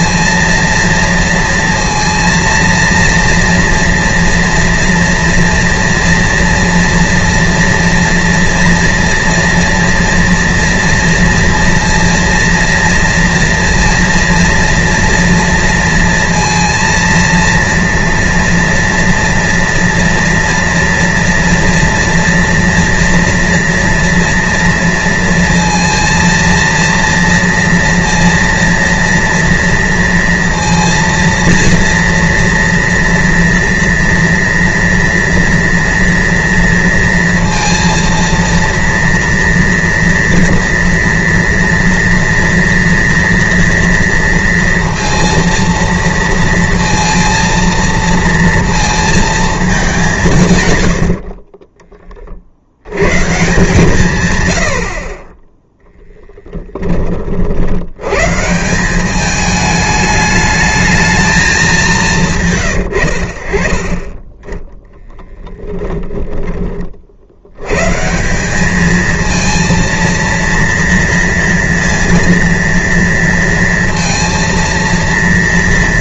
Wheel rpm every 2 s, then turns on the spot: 230, 230, 230, 230, 230, 240, 230, 230, 230, 230, 230, 230, 230, 230, 230, 230, 230, 230, 230, 230, 230, 230, 230, 230, 230, 130, 90, 80, 20, 170, 220, 130, 10, 30, 210, 230, 230, 230.
none